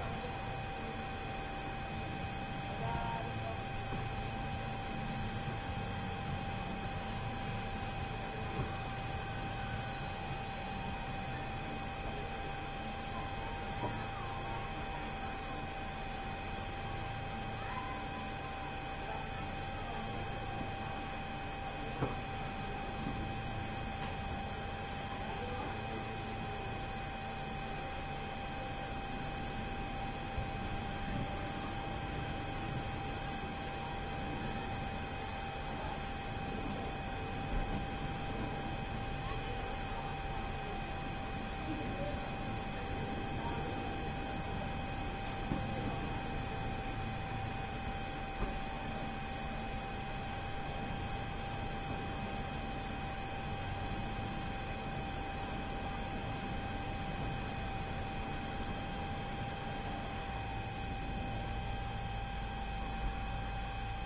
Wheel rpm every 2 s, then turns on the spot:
0, 0, 0, 0, 0, 0, 0, 0, 0, 0, 0, 0, 0, 0, 0, 0, 0, 0, 0, 0, 0, 0, 0, 0, 0, 0, 0, 0, 0, 0, 0, 0.
none